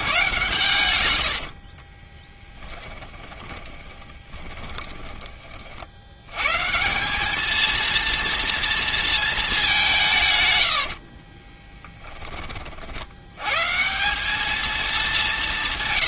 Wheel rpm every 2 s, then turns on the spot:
110, 10, 10, 150, 230, 80, 60, 210.
2-6 10-12